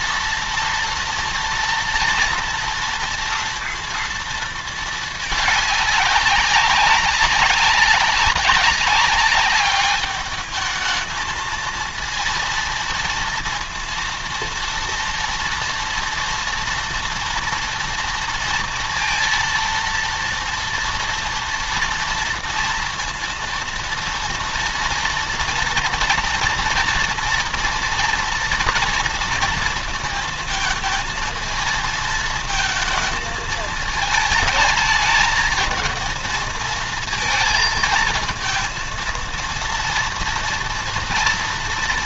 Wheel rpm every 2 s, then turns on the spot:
230, 230, 230, 200, 200, 210, 230, 230, 230, 230, 230, 230, 230, 230, 240, 220, 230, 220, 220, 230, 230.
none